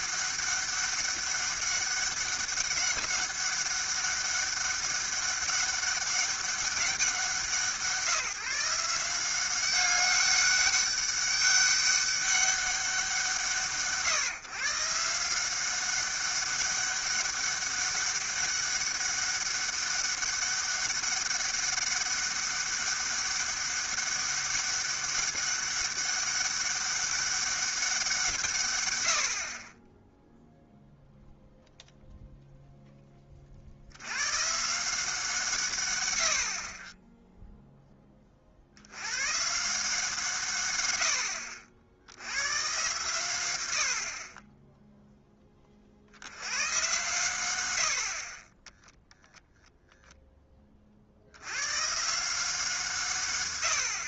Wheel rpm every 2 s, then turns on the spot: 200, 200, 200, 190, 170, 200, 180, 140, 200, 200, 200, 200, 200, 200, 130, 0, 0, 150, 40, 60, 120, 120, 10, 110, 10, 30, 170.
none